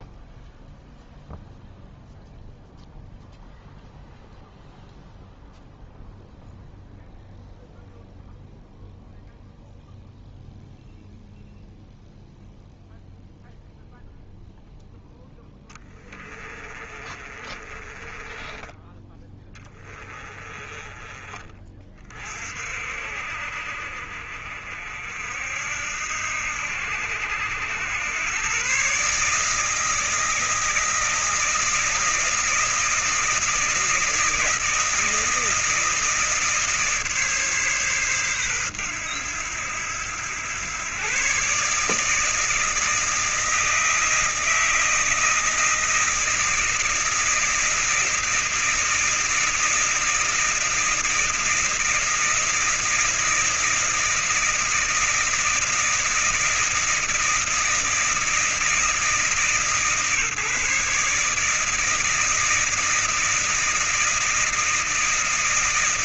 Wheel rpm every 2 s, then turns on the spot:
0, 0, 0, 0, 0, 0, 0, 0, 30, 10, 40, 50, 60, 80, 140, 160, 160, 160, 150, 110, 120, 160, 160, 160, 170, 160, 160, 160, 160, 160, 150, 160, 160.
16-18